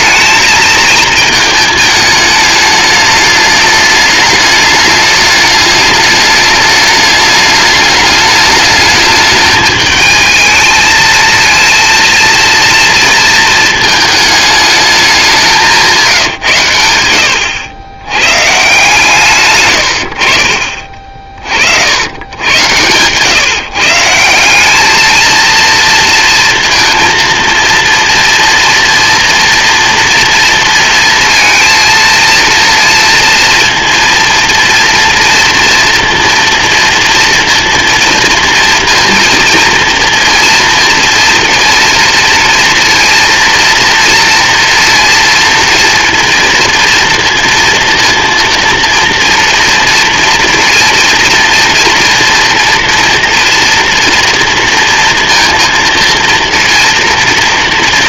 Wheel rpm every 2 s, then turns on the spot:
220, 210, 210, 210, 210, 220, 230, 210, 120, 130, 50, 110, 190, 230, 240, 230, 230, 230, 230, 230, 230, 230, 230, 230, 230, 240, 240, 230, 230.
none